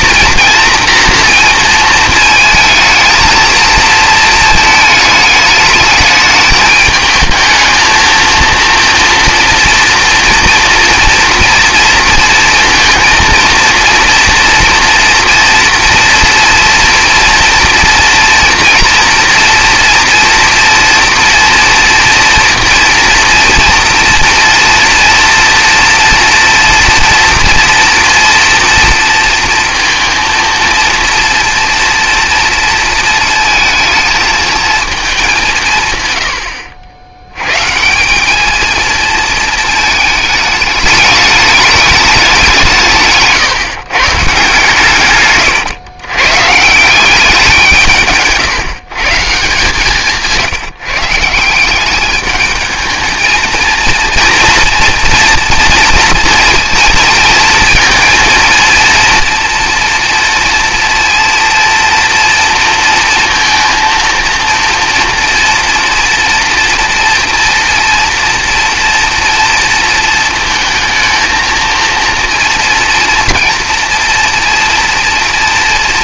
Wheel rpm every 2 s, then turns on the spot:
230, 220, 220, 220, 230, 230, 230, 240, 230, 230, 230, 230, 230, 230, 230, 230, 230, 220, 90, 230, 210, 160, 130, 180, 140, 160, 220, 230, 230, 230, 230, 230, 230, 230, 240, 230, 230, 230.
none